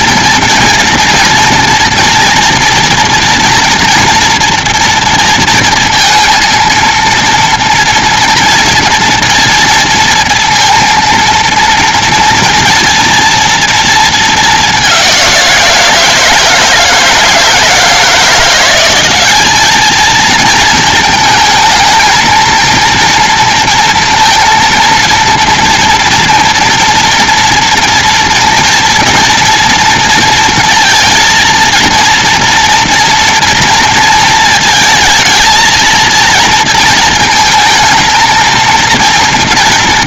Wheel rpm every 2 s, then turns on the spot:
230, 230, 240, 230, 230, 230, 230, 210, 160, 170, 220, 230, 230, 230, 230, 230, 230, 230, 230, 230.
none